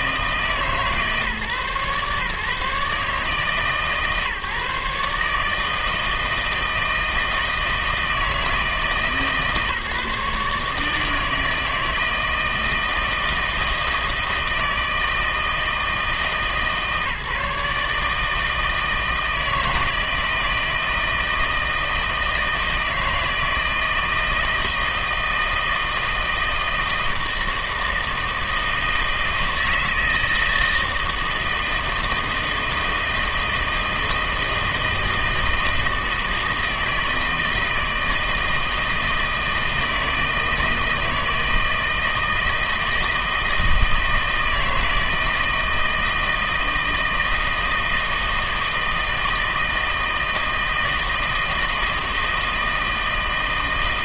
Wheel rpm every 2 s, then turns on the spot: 150, 150, 150, 160, 150, 150, 160, 160, 150, 160, 160, 160, 160, 160, 160, 160, 160, 160, 160, 160, 160, 160, 160, 160, 160, 160, 160.
none